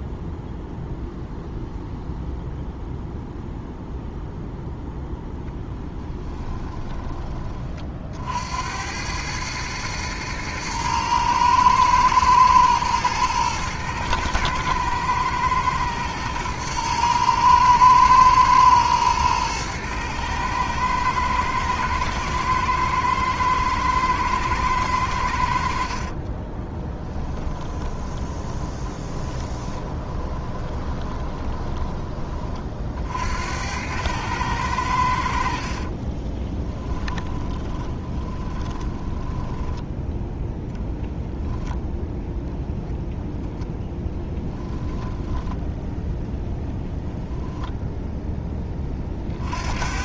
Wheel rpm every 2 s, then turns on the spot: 0, 0, 10, 20, 90, 110, 110, 110, 120, 110, 110, 110, 100, 20, 20, 20, 50, 90, 20, 20, 0, 0, 10, 0, 20.
26-32 36-40 44-46